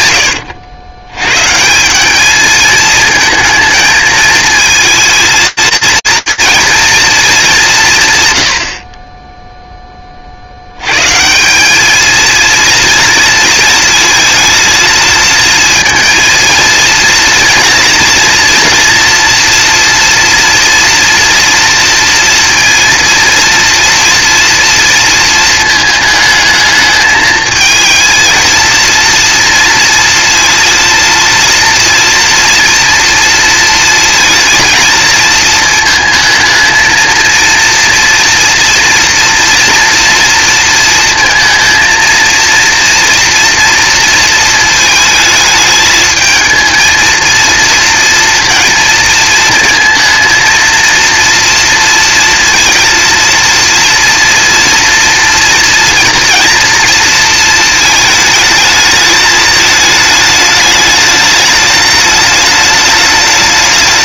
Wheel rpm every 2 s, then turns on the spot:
80, 220, 220, 230, 60, 120, 230, 220, 230, 230, 230, 230, 230, 220, 230, 230, 230, 230, 230, 240, 230, 230, 220, 220, 230, 230, 230, 230, 230, 220, 210, 210.
none